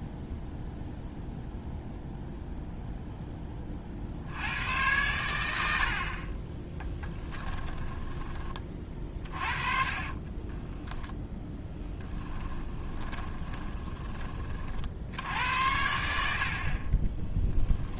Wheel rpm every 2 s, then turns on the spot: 0, 0, 90, 10, 40, 10, 20, 60, 40.
6-10 12-14 16-18